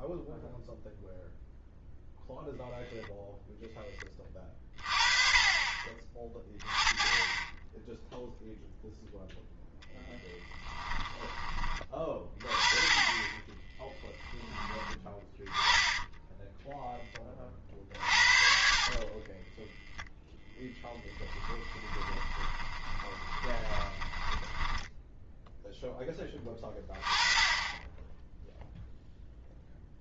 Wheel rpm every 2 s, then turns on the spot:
0, 0, 30, 20, 0, 20, 30, 10, 10, 40, 10, 20, 10, 20, 0.
10-12 18-26